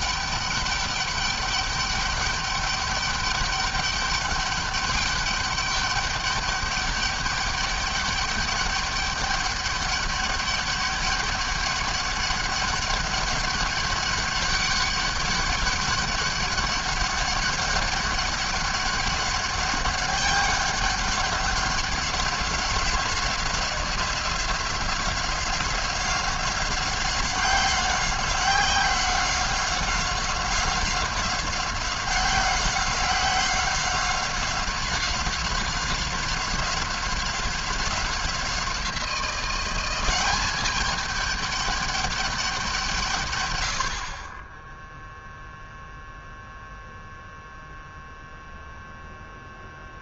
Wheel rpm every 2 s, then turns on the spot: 200, 200, 200, 200, 200, 200, 200, 200, 200, 200, 200, 190, 180, 190, 190, 190, 190, 190, 190, 180, 190, 190, 20, 0, 0.
none